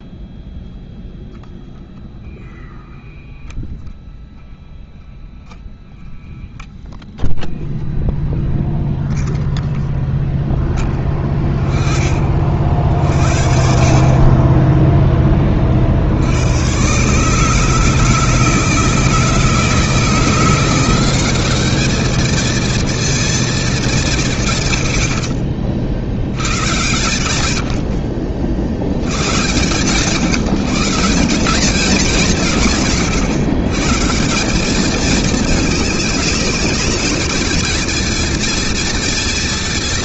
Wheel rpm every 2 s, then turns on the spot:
0, 0, 0, 0, 0, 10, 50, 20, 140, 160, 190, 230, 60, 110, 110, 180, 130, 210, 220, 220.
none